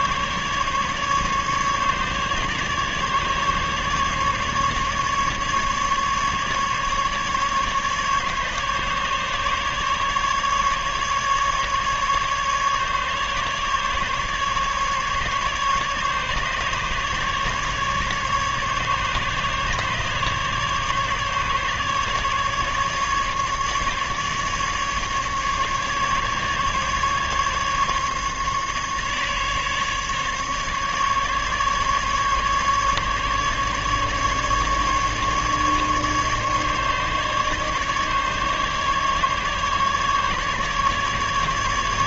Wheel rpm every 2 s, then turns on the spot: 140, 140, 150, 150, 140, 150, 150, 140, 140, 150, 150, 150, 150, 150, 150, 150, 140, 150, 140, 140, 150.
none